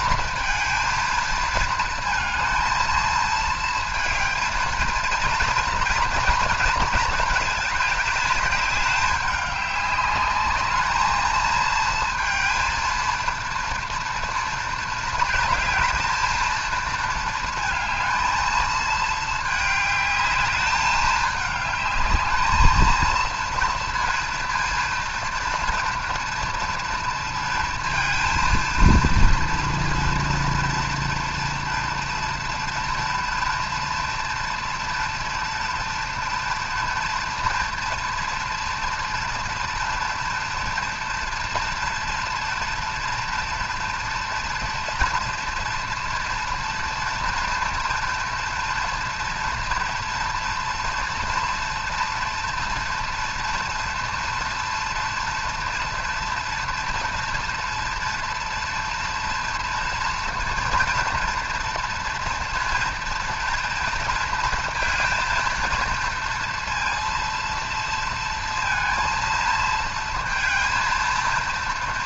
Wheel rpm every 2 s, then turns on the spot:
220, 230, 230, 230, 210, 210, 230, 220, 230, 220, 210, 220, 230, 230, 230, 230, 230, 240, 230, 230, 230, 230, 230, 230, 230, 230, 230, 240, 230, 230, 230, 230, 230, 230, 230, 230.
none